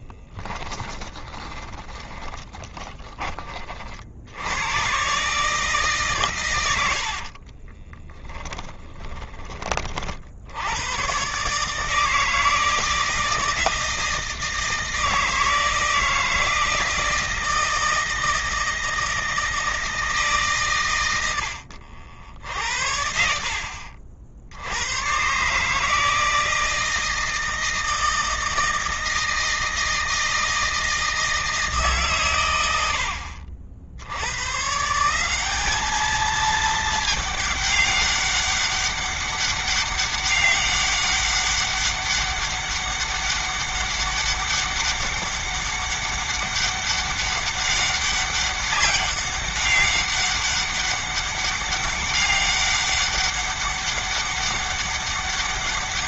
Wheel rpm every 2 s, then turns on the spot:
10, 10, 90, 110, 10, 80, 160, 160, 160, 160, 140, 60, 80, 160, 160, 160, 110, 120, 220, 200, 200, 200, 200, 200, 200, 200, 200, 200.
0-4 6-10